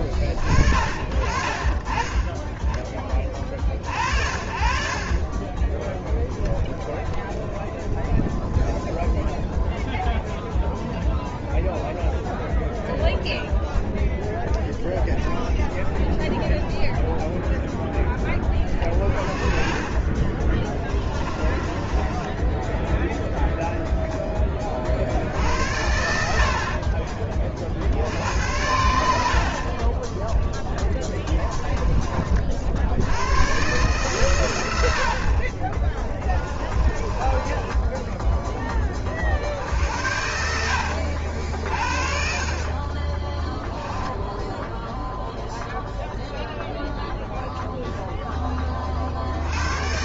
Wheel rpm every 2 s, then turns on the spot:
50, 20, 40, 0, 0, 0, 0, 0, 0, 30, 20, 10, 40, 40, 80, 20, 60, 80, 20, 20, 80, 30, 0, 0, 30.
18-22 30-32 36-38 42-44